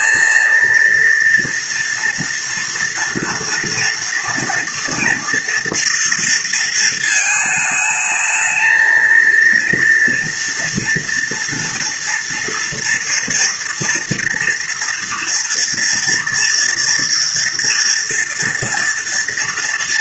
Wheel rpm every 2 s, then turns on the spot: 230, 230, 230, 230, 220, 240, 230, 230, 230, 230.
none